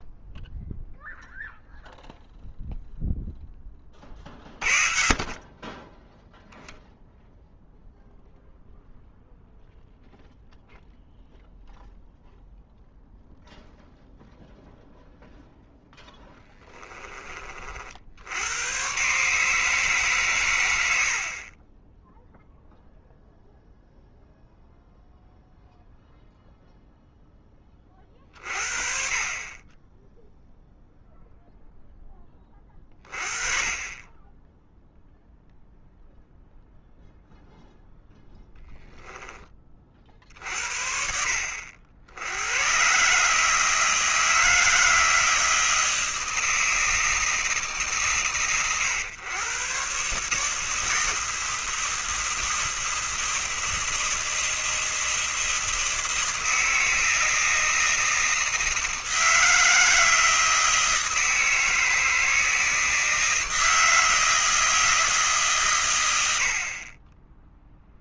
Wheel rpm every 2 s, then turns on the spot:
0, 0, 30, 0, 0, 0, 0, 0, 20, 110, 80, 0, 0, 0, 40, 0, 20, 0, 0, 10, 60, 120, 160, 160, 110, 160, 160, 160, 160, 160, 160, 160, 160, 40.
32-34